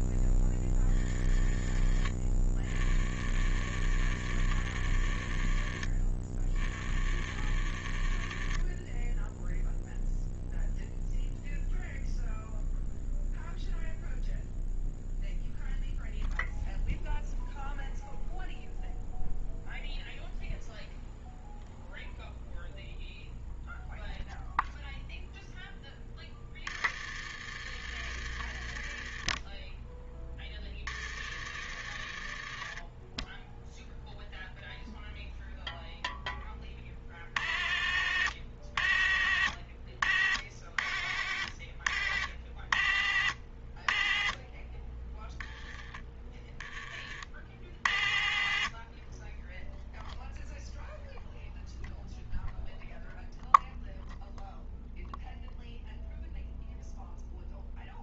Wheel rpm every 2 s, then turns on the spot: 20, 40, 50, 40, 20, 0, 0, 0, 0, 0, 0, 0, 0, 40, 50, 40, 30, 0, 30, 70, 60, 60, 20, 20, 50, 0, 0, 0, 0.
none